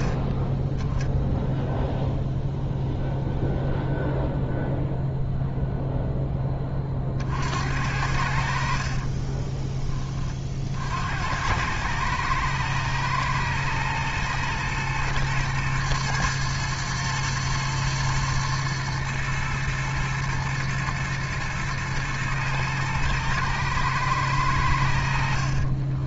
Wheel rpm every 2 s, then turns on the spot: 20, 0, 0, 30, 50, 70, 120, 120, 110, 120, 110, 110, 70.
8-10